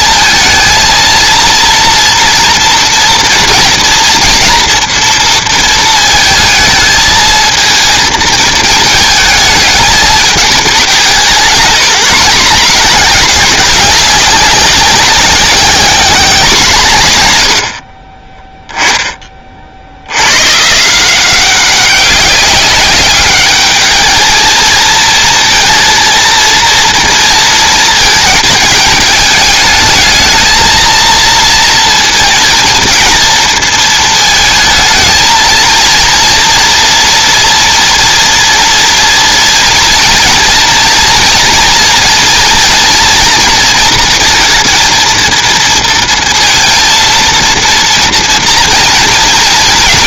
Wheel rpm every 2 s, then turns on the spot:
220, 230, 230, 220, 220, 190, 200, 190, 180, 10, 140, 200, 230, 230, 210, 230, 230, 220, 230, 230, 230, 230, 230, 230, 230.
none